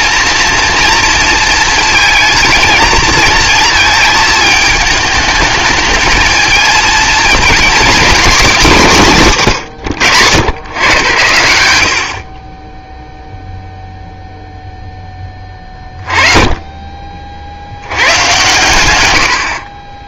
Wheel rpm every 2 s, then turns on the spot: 230, 230, 220, 220, 220, 120, 20, 0, 20, 130.
none